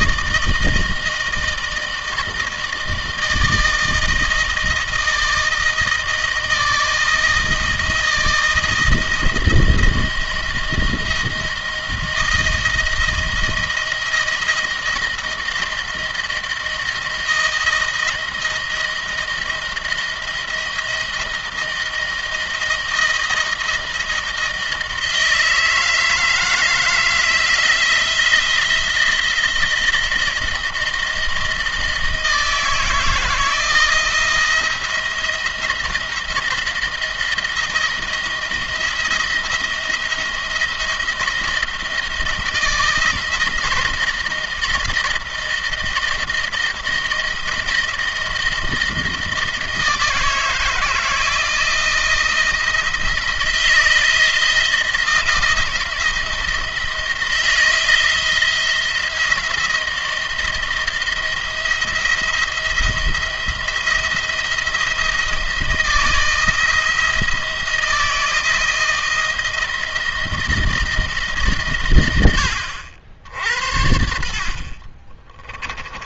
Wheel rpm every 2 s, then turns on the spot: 160, 160, 160, 160, 160, 170, 160, 160, 160, 160, 170, 170, 160, 160, 170, 160, 160, 170, 170, 170, 170, 170, 160, 160, 160, 160, 160, 160, 160, 160, 170, 170, 170, 160, 160, 160, 90, 50.
74-76